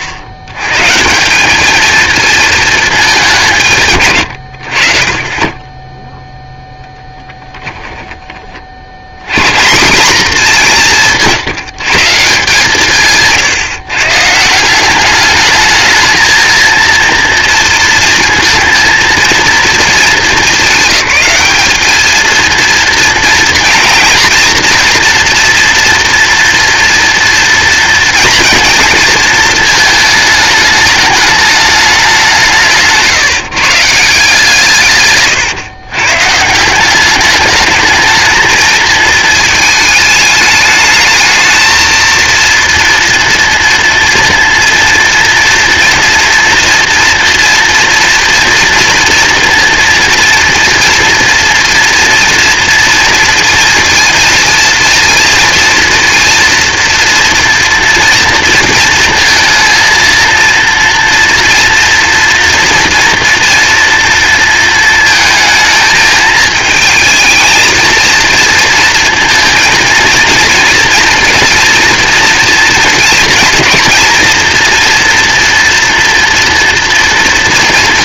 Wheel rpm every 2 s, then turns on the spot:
90, 220, 70, 0, 60, 200, 160, 170, 230, 230, 190, 230, 230, 230, 230, 210, 160, 150, 180, 220, 220, 230, 230, 230, 230, 230, 230, 230, 230, 230, 230, 230, 230, 220, 230, 230, 230, 240, 240.
none